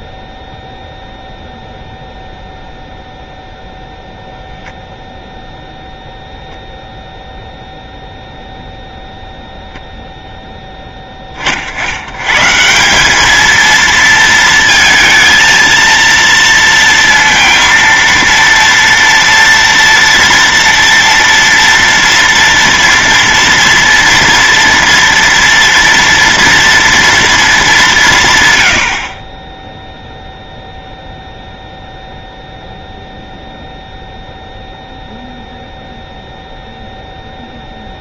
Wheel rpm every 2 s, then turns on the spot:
0, 0, 0, 0, 0, 10, 160, 230, 230, 230, 230, 230, 230, 230, 100, 0, 0, 0, 0.
none